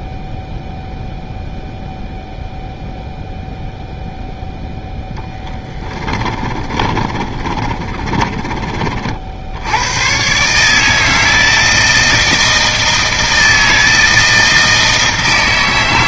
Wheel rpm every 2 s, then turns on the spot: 0, 0, 10, 30, 60, 160, 160, 140.
4-8